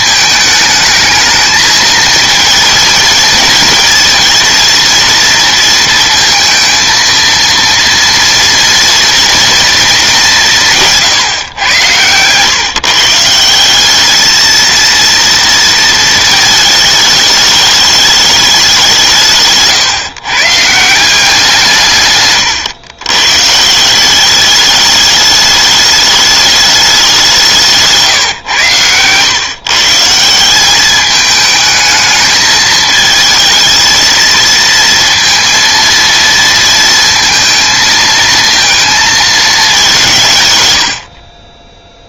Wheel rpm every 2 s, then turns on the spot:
220, 230, 230, 230, 230, 170, 140, 230, 220, 200, 140, 120, 200, 210, 120, 180, 220, 230, 230, 230, 110.
none